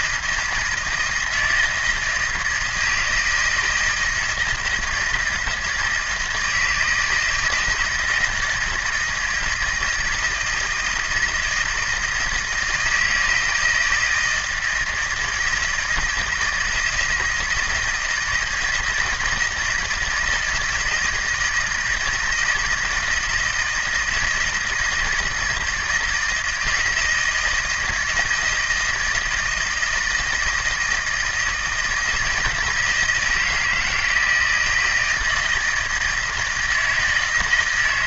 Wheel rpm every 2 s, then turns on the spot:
160, 160, 160, 160, 160, 160, 160, 170, 160, 160, 160, 160, 160, 160, 160, 160, 160, 160, 160.
none